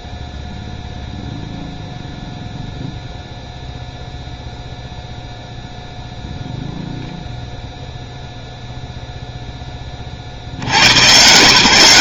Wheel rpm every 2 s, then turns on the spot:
0, 0, 0, 0, 0, 90.
none